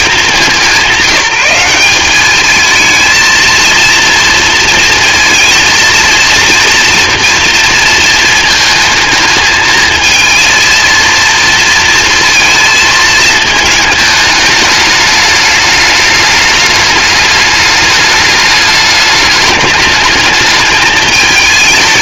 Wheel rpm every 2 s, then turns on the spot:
190, 220, 230, 230, 220, 230, 220, 210, 210, 210, 220.
none